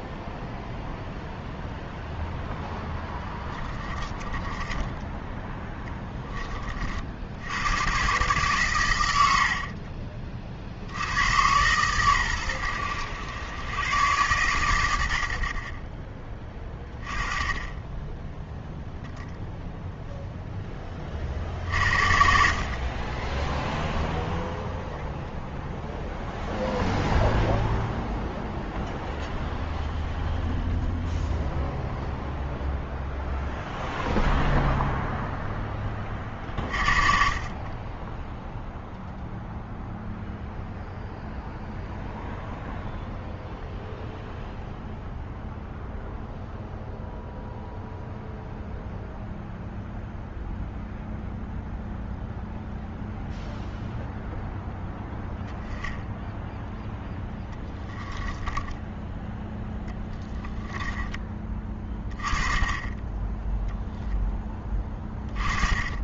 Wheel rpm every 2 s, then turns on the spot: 0, 10, 10, 40, 120, 60, 100, 110, 20, 0, 10, 40, 0, 0, 0, 0, 0, 0, 40, 0, 0, 0, 0, 0, 0, 0, 0, 0, 0, 10, 20, 20, 20.
2-6 60-62